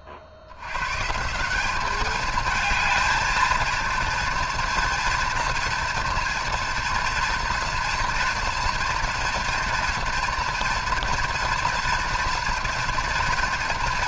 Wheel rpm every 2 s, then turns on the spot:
110, 220, 240, 230, 230, 230, 230.
none